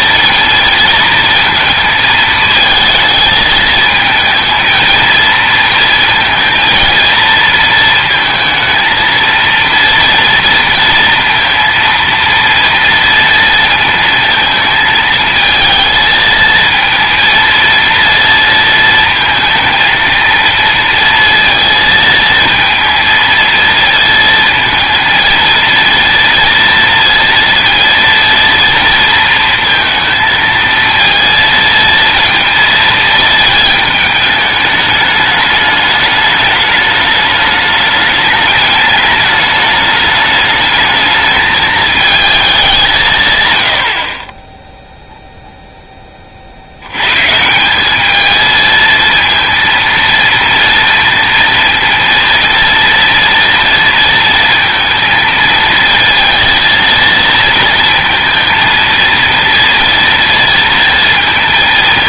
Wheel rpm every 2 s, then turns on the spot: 230, 220, 220, 230, 220, 230, 230, 220, 230, 230, 230, 230, 230, 230, 230, 230, 230, 210, 210, 210, 220, 190, 0, 80, 230, 230, 230, 230, 230, 230, 230.
none